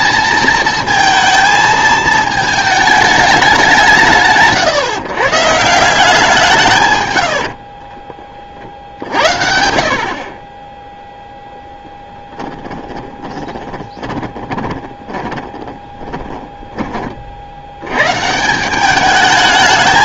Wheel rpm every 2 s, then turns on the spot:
230, 220, 140, 160, 60, 10, 10, 20, 20, 180.
12-16